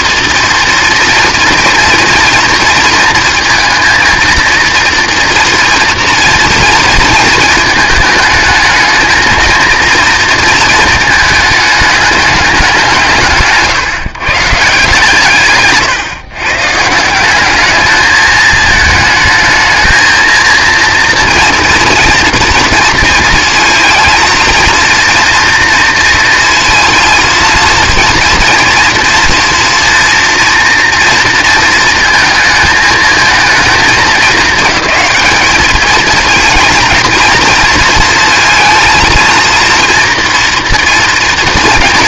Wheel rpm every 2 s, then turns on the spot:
230, 230, 230, 230, 220, 230, 200, 150, 140, 220, 230, 230, 230, 230, 230, 230, 230, 220, 230, 230, 230.
none